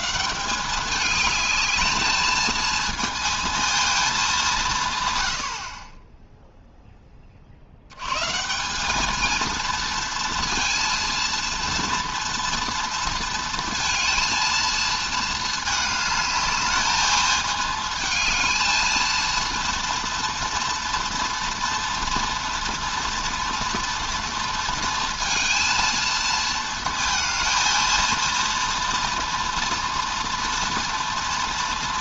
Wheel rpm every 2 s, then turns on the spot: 200, 220, 160, 0, 190, 230, 230, 230, 210, 220, 230, 240, 230, 230, 230, 240.
none